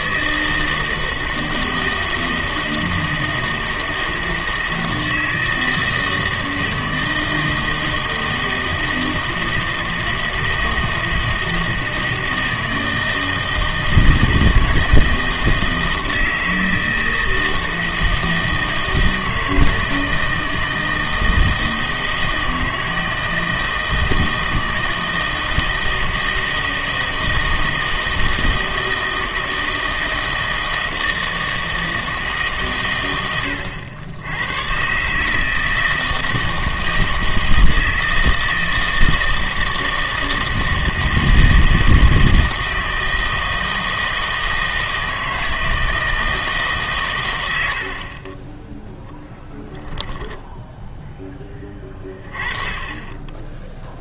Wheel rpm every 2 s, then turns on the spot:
160, 160, 160, 160, 160, 160, 160, 160, 160, 160, 160, 160, 160, 160, 160, 160, 150, 110, 160, 160, 160, 160, 160, 150, 10, 0, 20.
none